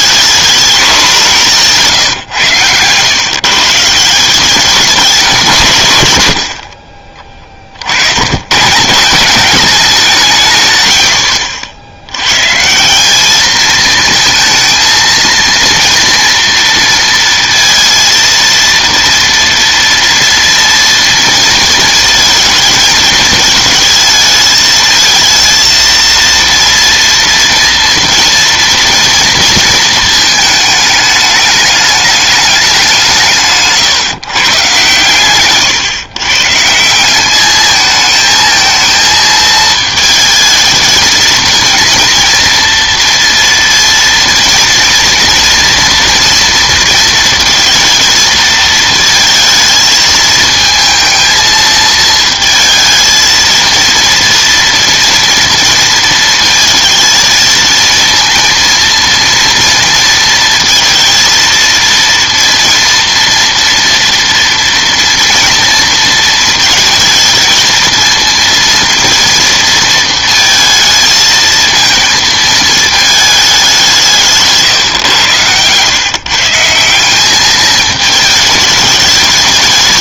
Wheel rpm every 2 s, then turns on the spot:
210, 120, 200, 60, 140, 120, 160, 230, 230, 230, 230, 220, 220, 230, 230, 220, 200, 140, 170, 220, 220, 230, 230, 230, 220, 220, 220, 230, 230, 230, 230, 240, 230, 220, 230, 230, 220, 140, 160, 210.
74-76